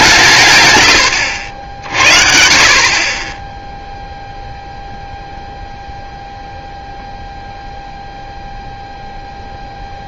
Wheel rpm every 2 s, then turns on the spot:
110, 50, 0, 0, 0.
none